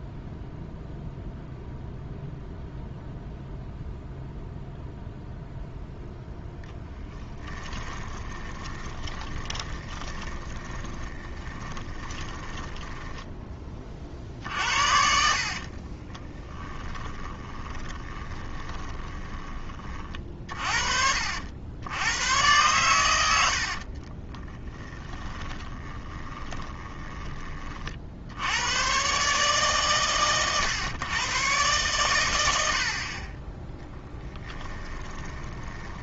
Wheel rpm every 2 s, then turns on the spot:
0, 0, 0, 10, 20, 20, 20, 50, 10, 20, 50, 110, 20, 30, 110, 110, 70, 20.
6-20 24-28 34-36